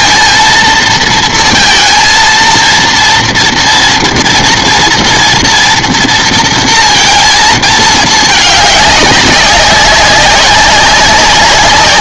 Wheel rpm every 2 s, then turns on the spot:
230, 230, 230, 230, 210, 190.
none